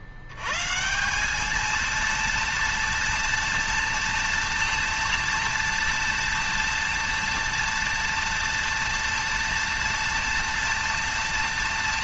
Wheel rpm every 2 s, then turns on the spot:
70, 230, 230, 230, 230, 230.
none